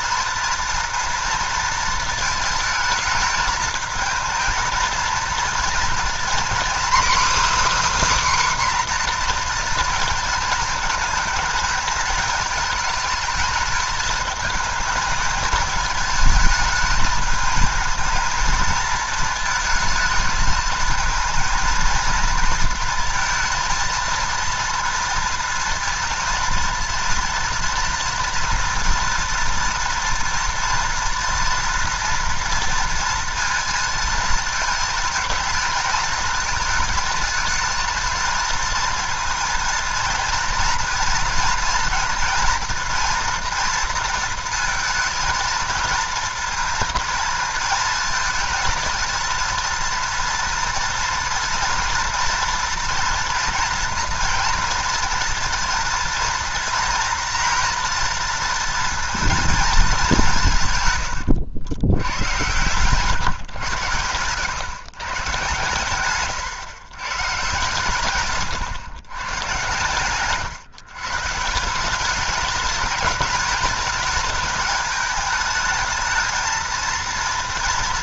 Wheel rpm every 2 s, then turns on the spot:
230, 220, 220, 270, 270, 230, 210, 220, 220, 220, 220, 230, 230, 230, 230, 230, 230, 230, 230, 230, 240, 230, 230, 230, 220, 230, 230, 230, 230, 230, 130, 110, 130, 120, 120, 130, 210, 210, 230.
none